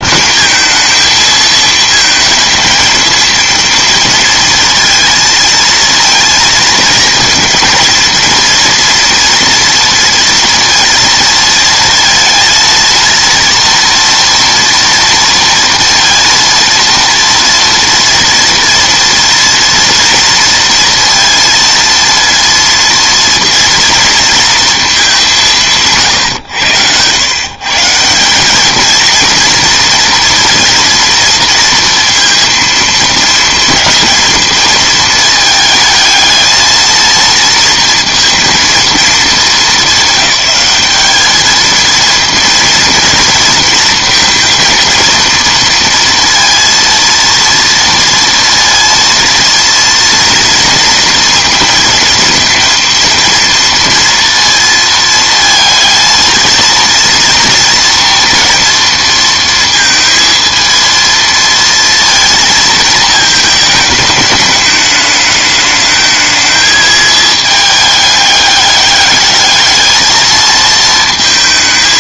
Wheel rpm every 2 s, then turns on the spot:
220, 220, 230, 220, 230, 230, 230, 240, 230, 230, 230, 230, 230, 100, 210, 230, 230, 220, 220, 230, 200, 230, 230, 230, 230, 230, 230, 230, 230, 230, 230, 220, 210, 220, 200, 220.
none